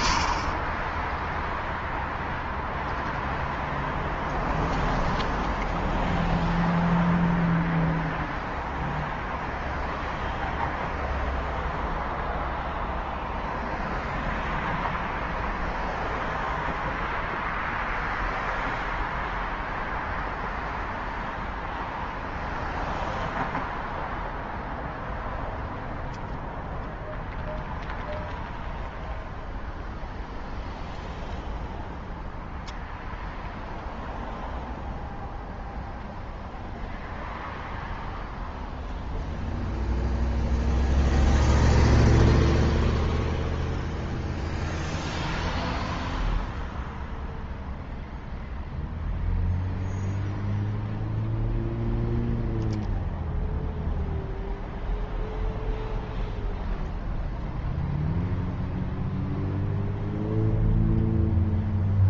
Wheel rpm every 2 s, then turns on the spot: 0, 0, 0, 0, 0, 0, 0, 0, 0, 0, 0, 0, 0, 0, 0, 0, 0, 0, 0, 0, 0, 0, 0, 0, 0, 0, 0, 0, 0, 0, 0.
none